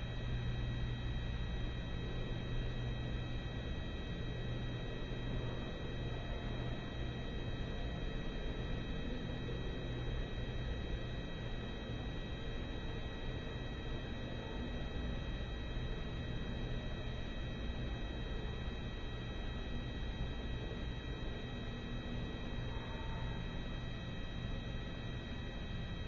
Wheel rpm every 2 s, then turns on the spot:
0, 0, 0, 0, 0, 0, 0, 0, 0, 0, 0, 0, 0.
none